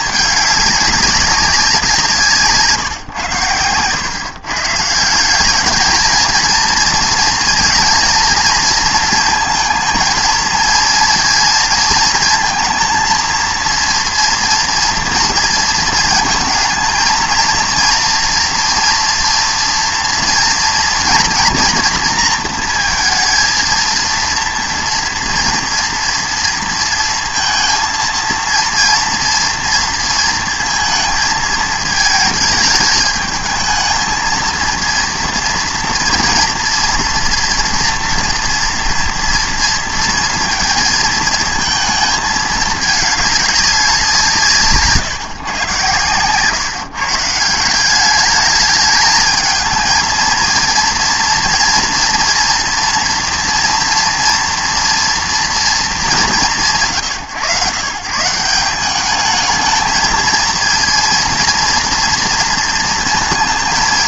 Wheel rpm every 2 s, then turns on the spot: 200, 150, 140, 230, 230, 220, 230, 230, 230, 230, 230, 230, 230, 230, 230, 230, 220, 230, 230, 230, 230, 210, 140, 130, 210, 230, 230, 230, 160, 160, 230, 230.
none